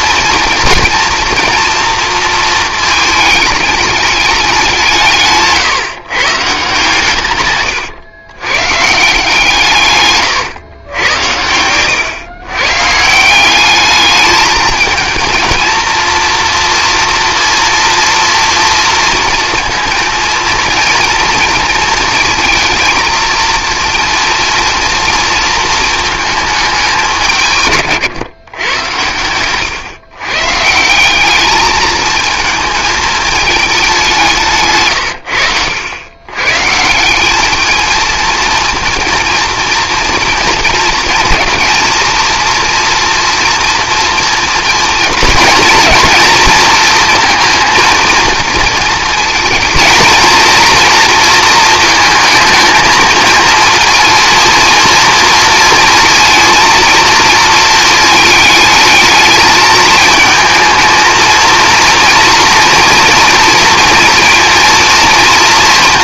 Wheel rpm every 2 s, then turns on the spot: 230, 220, 190, 150, 140, 120, 130, 220, 240, 230, 230, 230, 230, 210, 110, 160, 220, 150, 160, 230, 230, 240, 230, 230, 230, 230, 220, 230, 230, 210, 220, 230, 230.
34-36